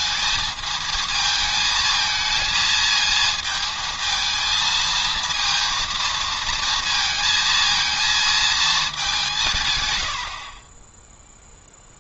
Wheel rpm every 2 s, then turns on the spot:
220, 230, 230, 230, 210, 20.
none